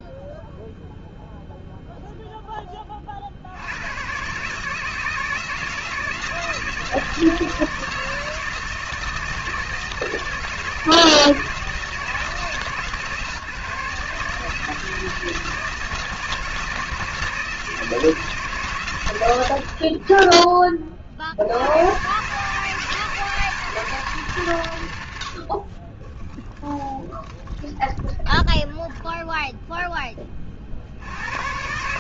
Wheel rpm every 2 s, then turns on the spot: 0, 10, 140, 160, 160, 160, 140, 150, 160, 140, 20, 140, 120, 0, 0, 30.
none